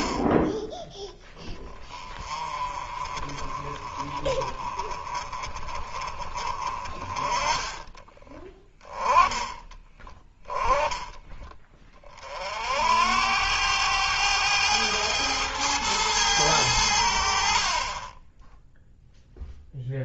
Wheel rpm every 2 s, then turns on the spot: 10, 30, 30, 40, 10, 10, 60, 100, 100, 10.
none